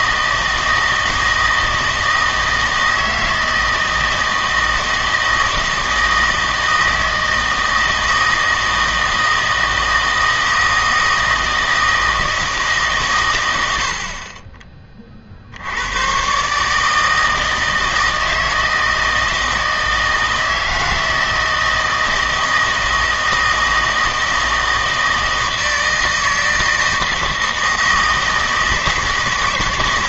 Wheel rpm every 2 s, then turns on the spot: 160, 160, 160, 160, 160, 160, 150, 30, 150, 160, 160, 160, 160, 160, 160.
none